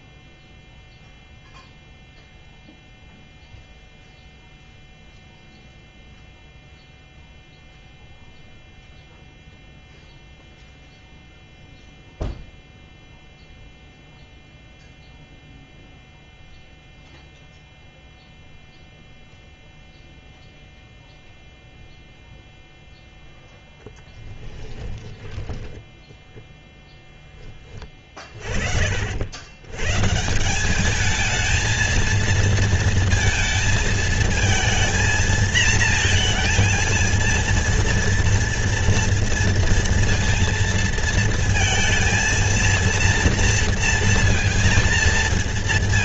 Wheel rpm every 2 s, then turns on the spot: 0, 0, 0, 0, 0, 0, 0, 0, 0, 0, 0, 0, 20, 10, 40, 200, 230, 230, 230, 230, 230, 230, 230.
24-26